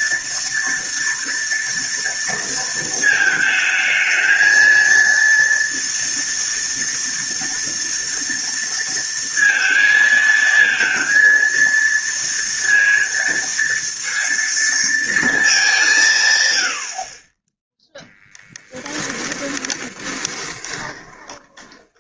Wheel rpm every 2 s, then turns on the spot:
230, 230, 220, 230, 230, 230, 230, 230, 110, 10, 20.
18-22